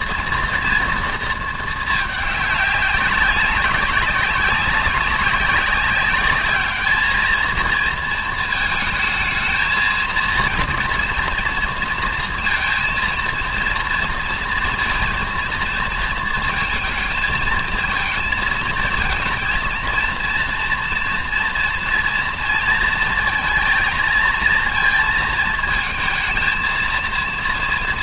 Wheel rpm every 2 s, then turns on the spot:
240, 200, 200, 210, 220, 240, 230, 230, 220, 220, 230, 230, 230, 220.
none